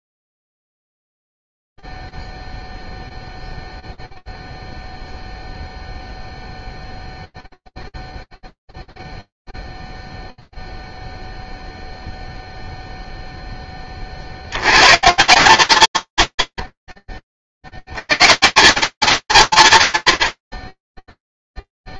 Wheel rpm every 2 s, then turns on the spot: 0, 0, 0, 0, 0, 0, 0, 80, 60, 160, 50.
none